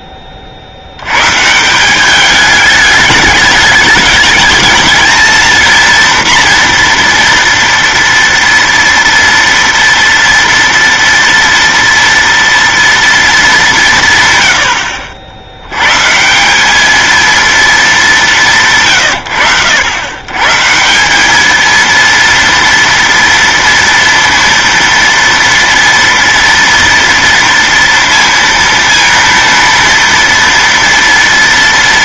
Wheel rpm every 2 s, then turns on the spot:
50, 210, 210, 230, 230, 230, 230, 100, 190, 180, 150, 230, 230, 230, 230, 230.
none